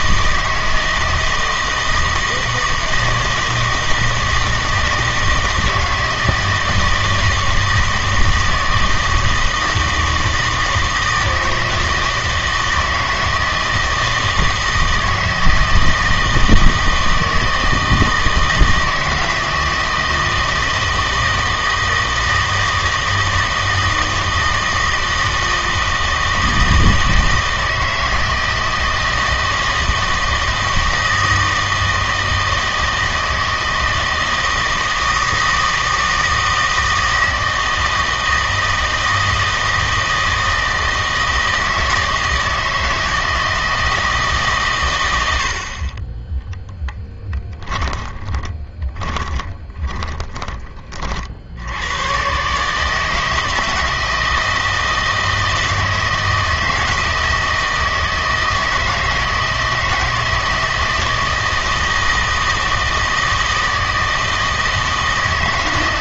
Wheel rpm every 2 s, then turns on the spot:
160, 160, 160, 160, 160, 160, 160, 160, 160, 160, 160, 160, 160, 160, 160, 160, 160, 160, 160, 160, 160, 160, 120, 10, 20, 20, 150, 160, 160, 160, 160, 160, 160.
46-50